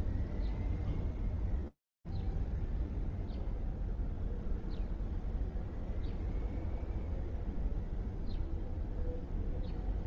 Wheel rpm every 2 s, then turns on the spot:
0, 0, 0, 0, 0.
none